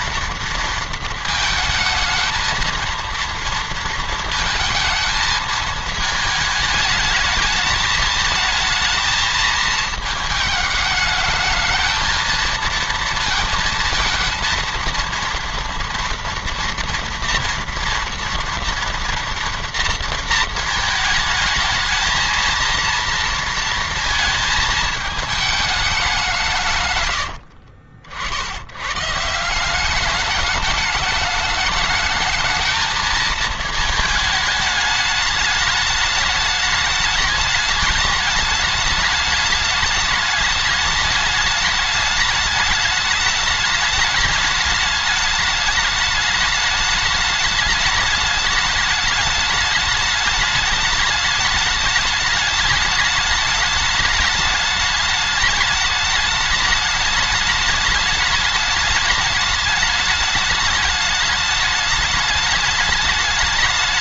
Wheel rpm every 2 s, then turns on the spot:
230, 230, 220, 220, 220, 210, 230, 230, 230, 230, 220, 230, 220, 130, 100, 210, 220, 210, 210, 210, 210, 210, 210, 210, 210, 210, 210, 210, 210, 210, 210, 210.
none